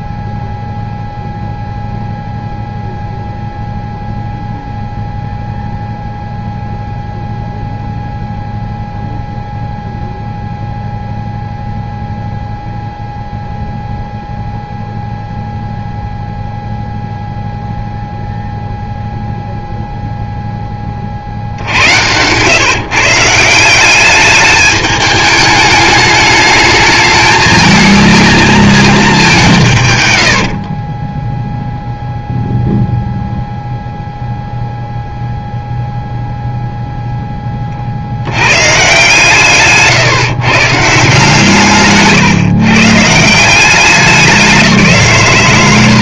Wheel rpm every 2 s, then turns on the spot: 0, 0, 0, 0, 0, 0, 0, 0, 0, 0, 10, 120, 210, 220, 230, 40, 0, 0, 0, 120, 140, 140, 180.
30-32